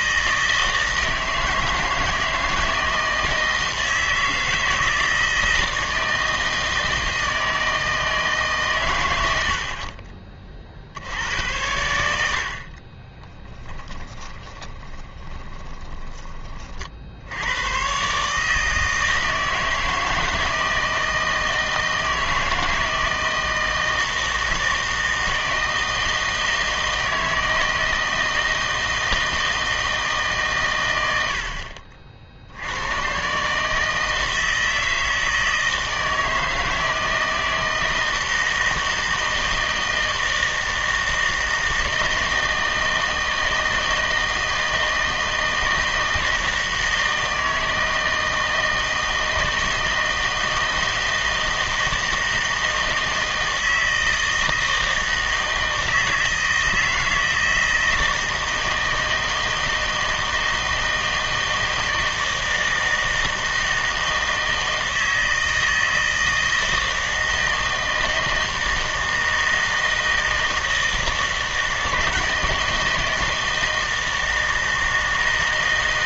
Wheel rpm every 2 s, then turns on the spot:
160, 160, 160, 160, 130, 50, 50, 20, 40, 160, 160, 160, 160, 160, 160, 130, 80, 160, 160, 160, 160, 160, 160, 160, 160, 160, 160, 160, 160, 160, 160, 160, 160, 160, 160, 160, 160, 160.
14-16